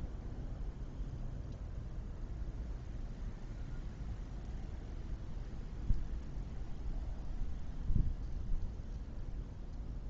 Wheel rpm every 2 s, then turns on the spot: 0, 0, 0, 0, 0.
none